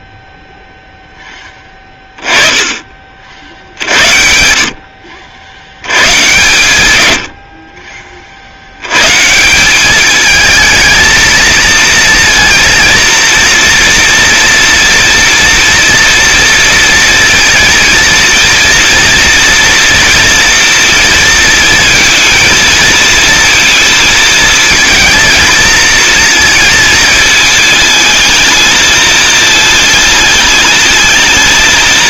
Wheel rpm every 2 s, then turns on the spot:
0, 20, 60, 110, 80, 220, 230, 230, 230, 230, 230, 230, 220, 230, 220, 210.
none